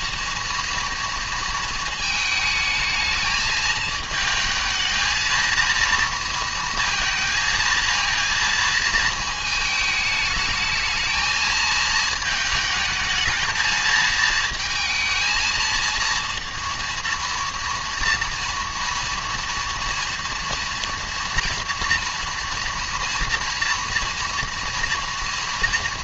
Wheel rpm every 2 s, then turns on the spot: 230, 220, 220, 230, 230, 220, 220, 220, 230, 230, 230, 240, 230.
none